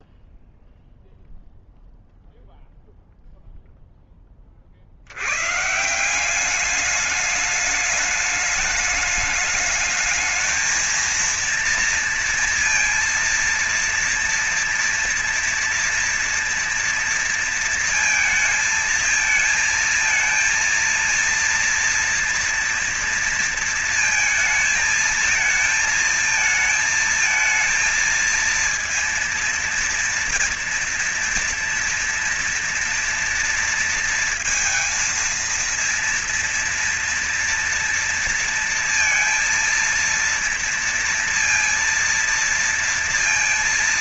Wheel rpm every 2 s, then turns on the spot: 0, 0, 20, 170, 210, 220, 230, 230, 230, 230, 230, 230, 220, 220, 220, 230, 230, 230, 230, 230, 230, 230.
none